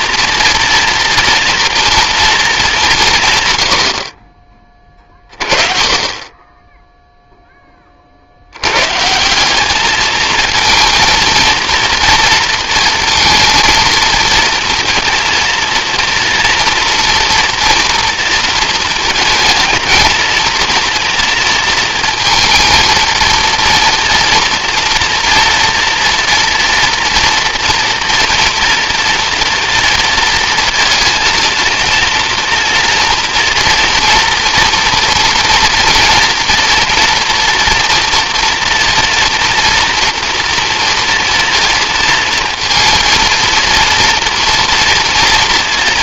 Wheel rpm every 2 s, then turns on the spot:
230, 230, 40, 30, 60, 220, 230, 230, 230, 230, 220, 230, 240, 230, 230, 230, 230, 230, 240, 240, 230, 230, 230.
none